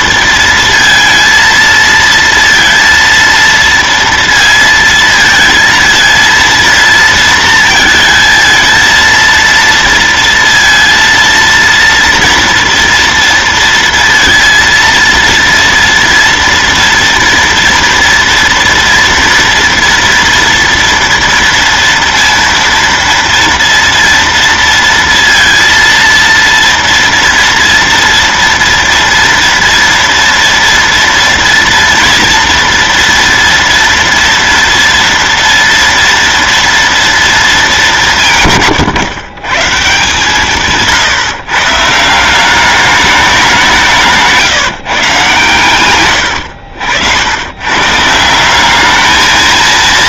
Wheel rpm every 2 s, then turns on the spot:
230, 230, 230, 230, 230, 230, 230, 230, 230, 230, 230, 230, 230, 230, 230, 230, 230, 230, 230, 160, 150, 170, 160, 100, 160.
none